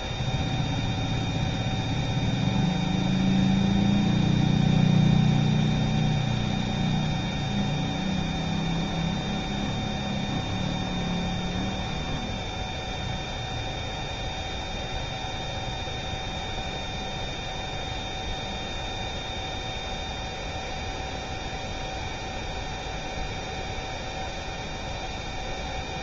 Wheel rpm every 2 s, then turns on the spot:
0, 0, 0, 0, 0, 0, 0, 0, 0, 0, 0, 0, 0.
none